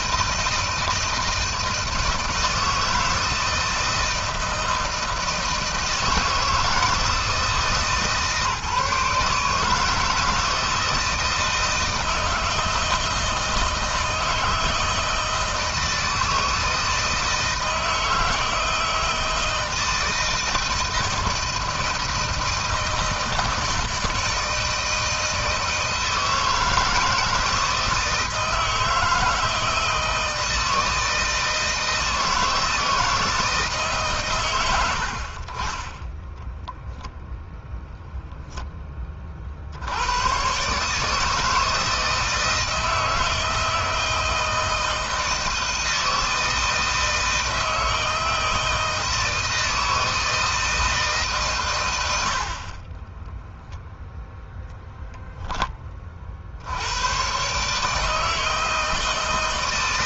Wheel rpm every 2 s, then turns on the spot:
160, 160, 160, 160, 150, 160, 160, 160, 160, 160, 160, 160, 160, 160, 160, 160, 160, 90, 10, 10, 130, 160, 160, 160, 160, 160, 40, 0, 80, 160.
52-54